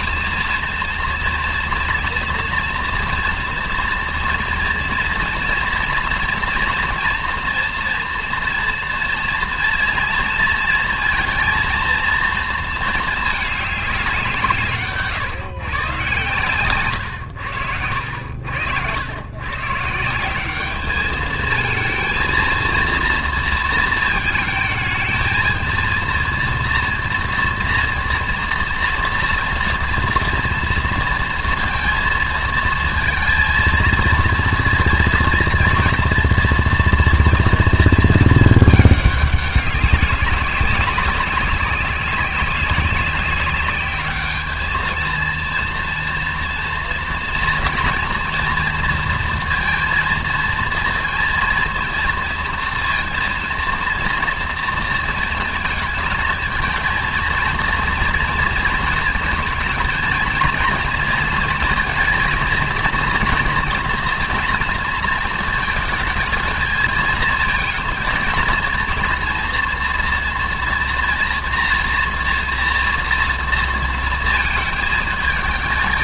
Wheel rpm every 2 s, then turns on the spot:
230, 230, 230, 230, 230, 230, 230, 160, 130, 80, 200, 230, 220, 230, 230, 230, 230, 230, 230, 210, 200, 190, 220, 230, 240, 230, 230, 230, 220, 230, 230, 220, 230, 220, 230, 240, 240, 220.
none